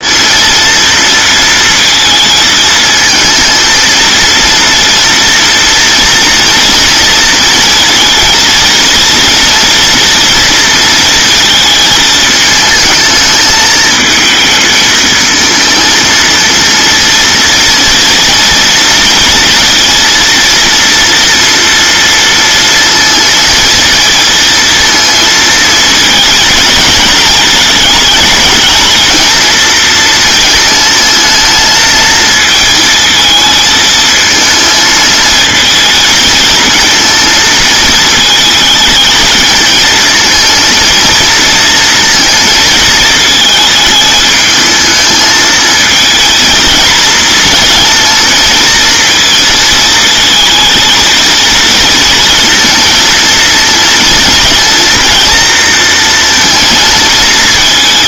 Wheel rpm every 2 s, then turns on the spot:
230, 230, 230, 240, 230, 230, 220, 220, 230, 230, 230, 230, 230, 220, 220, 230, 220, 220, 230, 220, 230, 220, 220, 230, 230, 220, 230, 230, 230.
none